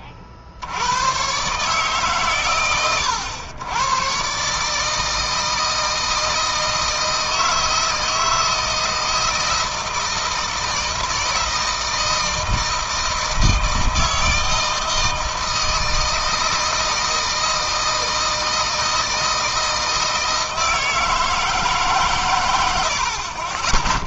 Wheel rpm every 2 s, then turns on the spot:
70, 120, 140, 160, 160, 160, 160, 160, 160, 160, 160, 90.
none